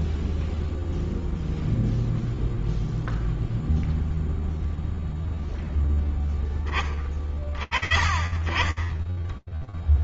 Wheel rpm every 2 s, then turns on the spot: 0, 0, 20, 30, 50.
none